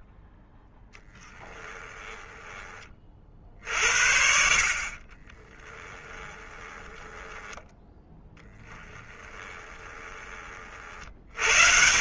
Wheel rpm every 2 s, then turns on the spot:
10, 10, 70, 30, 10, 30.
6-10